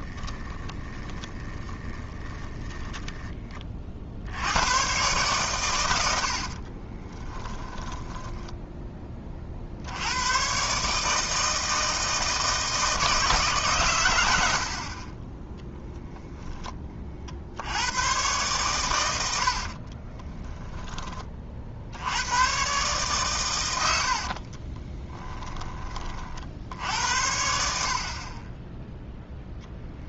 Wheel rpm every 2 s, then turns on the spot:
20, 10, 110, 30, 20, 150, 160, 50, 30, 110, 10, 130, 30, 70, 10.
0-4 6-8 24-26